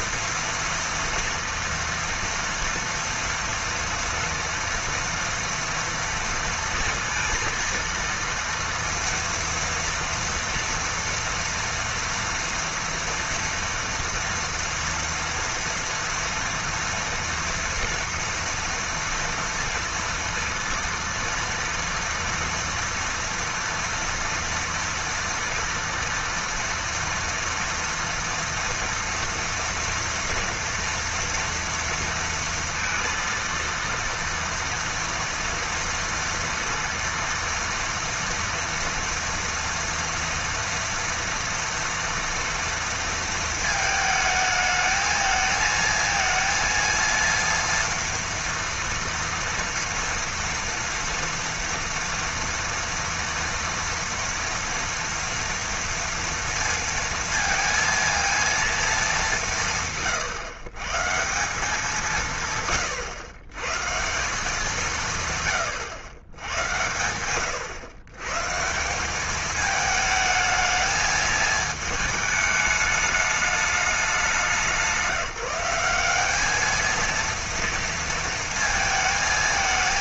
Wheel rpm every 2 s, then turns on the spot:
230, 240, 230, 230, 230, 230, 240, 230, 230, 230, 230, 230, 230, 230, 230, 230, 230, 230, 230, 230, 230, 230, 220, 230, 230, 230, 240, 230, 230, 230, 120, 150, 180, 100, 170, 220, 210, 180, 210, 230.
none